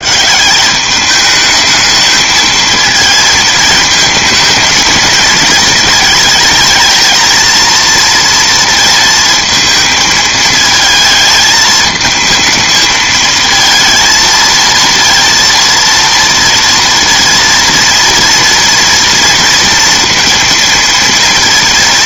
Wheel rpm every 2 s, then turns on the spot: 180, 220, 220, 220, 230, 220, 220, 230, 240, 240, 230.
none